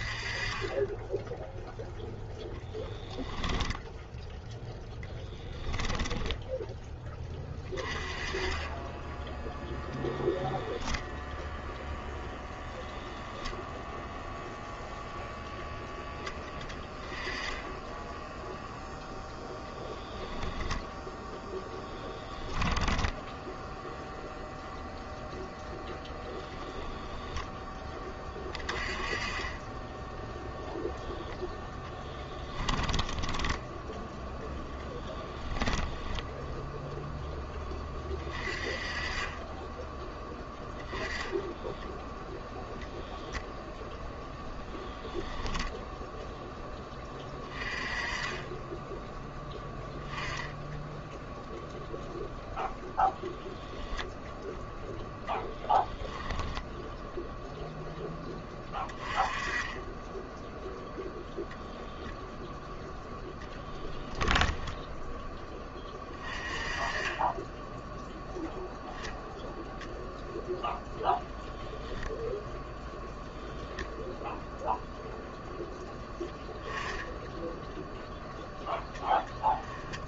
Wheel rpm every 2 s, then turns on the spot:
10, 0, 10, 10, 10, 0, 0, 0, 10, 0, 0, 0, 0, 0, 20, 0, 10, 10, 0, 20, 10, 0, 0, 10, 10, 10, 0, 0, 0, 20, 0, 0, 10, 20, 0, 0, 0, 0, 10, 10.
32-34